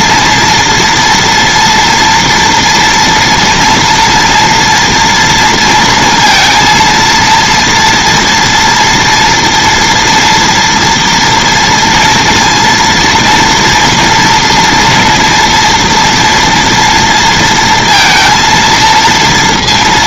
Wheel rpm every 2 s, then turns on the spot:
230, 230, 230, 230, 230, 240, 230, 230, 230, 230.
none